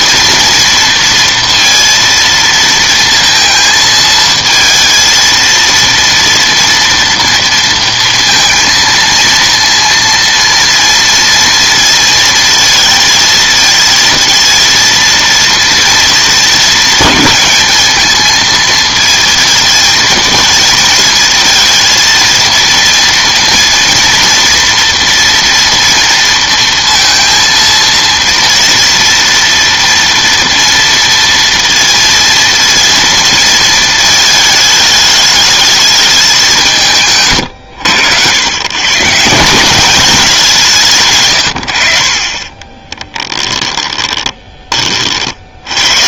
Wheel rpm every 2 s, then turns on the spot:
230, 230, 220, 230, 230, 230, 230, 230, 220, 230, 230, 230, 230, 230, 230, 230, 230, 210, 160, 120, 180, 20, 20.
42-44